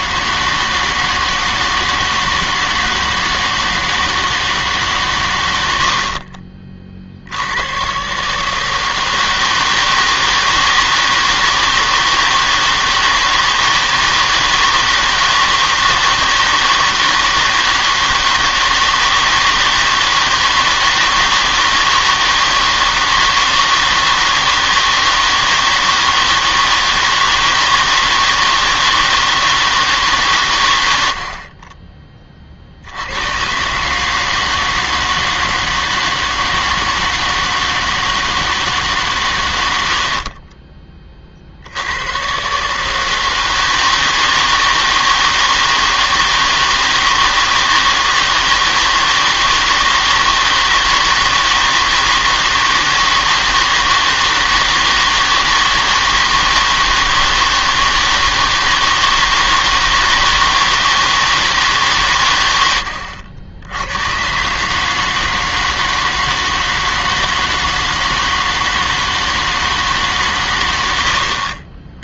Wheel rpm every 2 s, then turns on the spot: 160, 160, 150, 40, 160, 160, 160, 160, 160, 160, 160, 160, 160, 160, 160, 120, 60, 160, 160, 160, 30, 140, 160, 160, 160, 160, 160, 160, 160, 160, 160, 100, 140, 160, 160, 110.
40-42